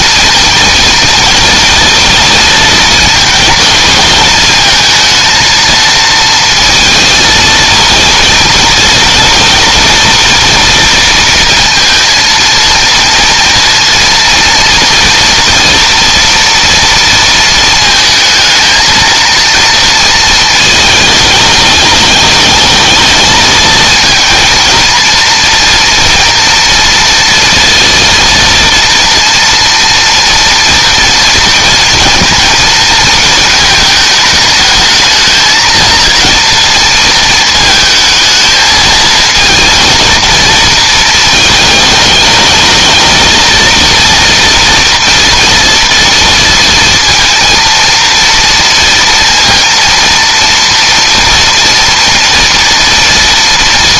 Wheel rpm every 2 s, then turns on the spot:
230, 230, 230, 230, 220, 230, 230, 230, 230, 230, 220, 220, 230, 230, 230, 230, 230, 220, 230, 220, 220, 220, 230, 230, 230, 230, 230.
none